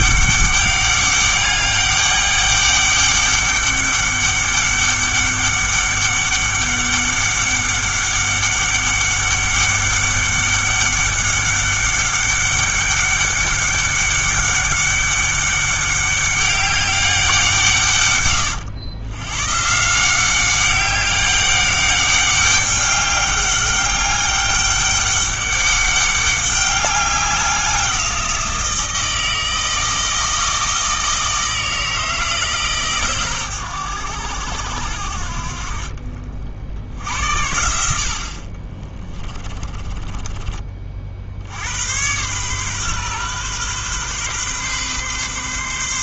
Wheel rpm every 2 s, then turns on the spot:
200, 200, 200, 200, 200, 200, 200, 200, 200, 110, 190, 200, 200, 200, 170, 160, 140, 80, 60, 30, 30, 130, 130.
none